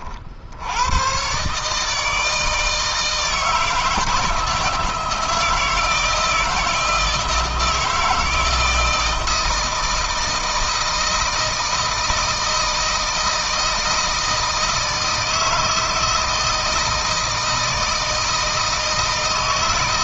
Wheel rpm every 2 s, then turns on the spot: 100, 160, 160, 160, 160, 160, 160, 160, 160, 160.
none